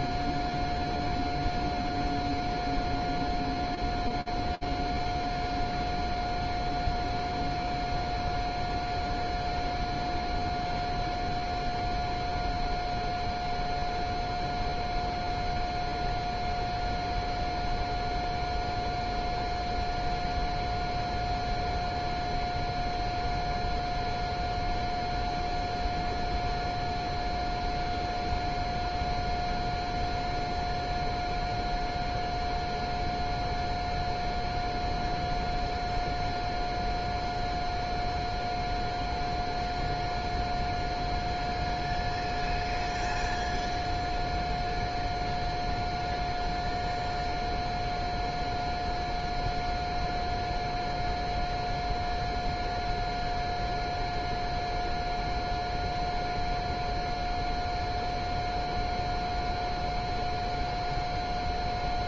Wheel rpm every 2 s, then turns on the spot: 0, 0, 0, 0, 0, 0, 0, 0, 0, 0, 0, 0, 0, 0, 0, 0, 0, 0, 0, 0, 0, 0, 0, 0, 0, 0, 0, 0, 0, 0, 0.
none